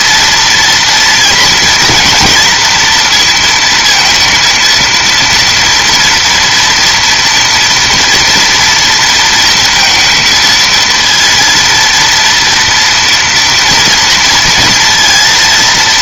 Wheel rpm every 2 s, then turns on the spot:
230, 230, 230, 230, 230, 220, 230, 230.
none